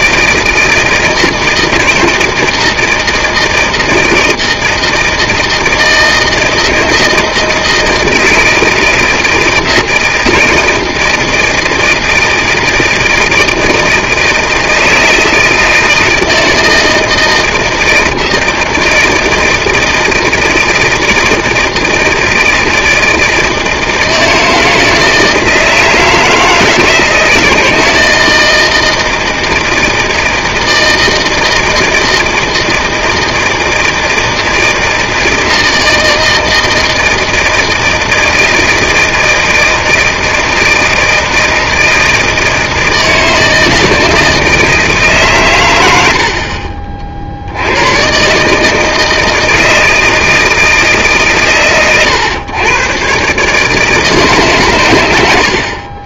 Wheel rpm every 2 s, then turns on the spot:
160, 160, 160, 160, 160, 160, 160, 160, 160, 160, 170, 160, 160, 160, 160, 160, 160, 160, 160, 160, 160, 160, 160, 40, 150, 160, 120, 130.
none